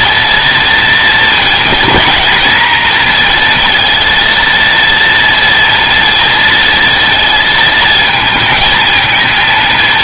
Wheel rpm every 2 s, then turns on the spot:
230, 240, 230, 230, 220.
none